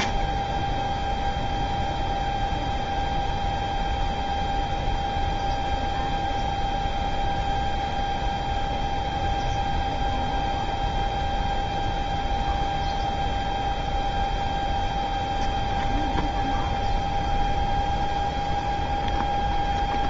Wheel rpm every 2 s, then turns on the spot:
10, 0, 0, 0, 0, 0, 0, 0, 0, 0.
none